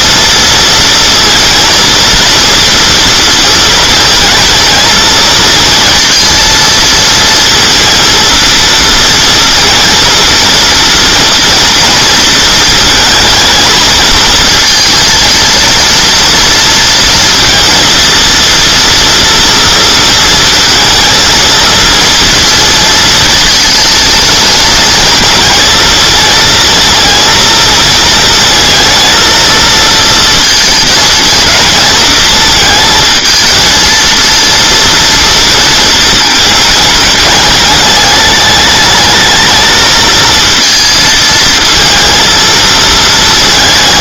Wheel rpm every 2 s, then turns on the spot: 230, 230, 230, 230, 230, 230, 220, 230, 230, 230, 230, 230, 230, 230, 230, 230, 220, 240, 220, 210, 230, 220.
none